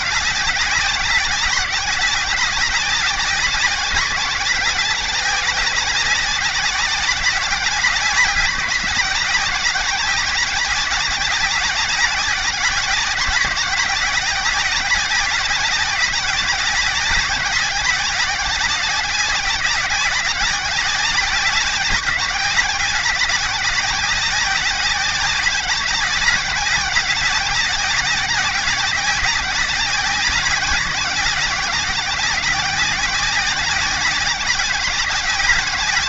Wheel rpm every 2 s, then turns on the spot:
190, 190, 190, 190, 180, 190, 190, 190, 190, 190, 190, 180, 190, 190, 190, 190, 190, 190.
none